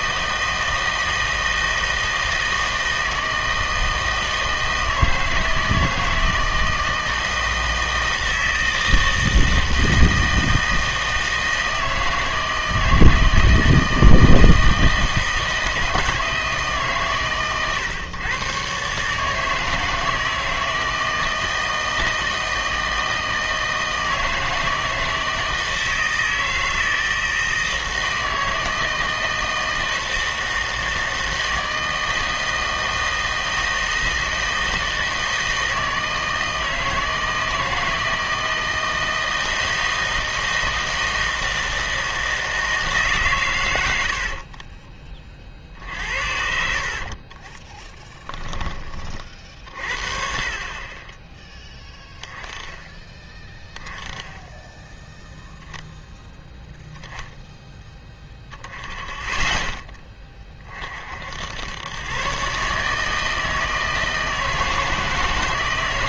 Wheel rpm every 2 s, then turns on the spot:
160, 160, 160, 160, 160, 160, 160, 160, 150, 130, 160, 160, 160, 160, 160, 160, 160, 160, 160, 160, 160, 160, 50, 60, 20, 40, 10, 10, 0, 10, 30, 140, 160.
44-46 48-50